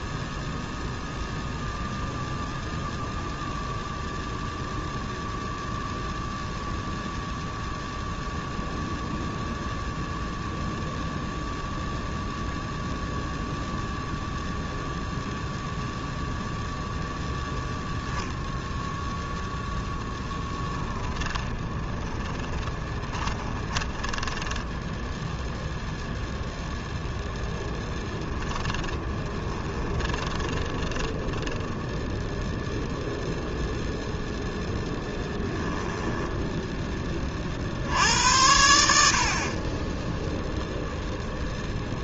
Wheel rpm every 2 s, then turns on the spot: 0, 0, 0, 0, 0, 0, 0, 0, 0, 0, 20, 20, 10, 0, 10, 20, 0, 10, 10, 80, 0.
20-26 28-32